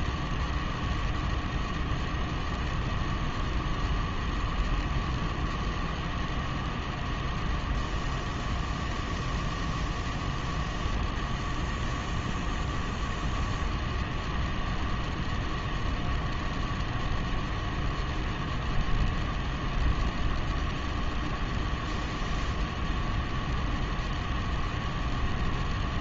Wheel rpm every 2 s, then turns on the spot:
0, 0, 0, 0, 0, 0, 0, 0, 0, 0, 0, 0, 0.
none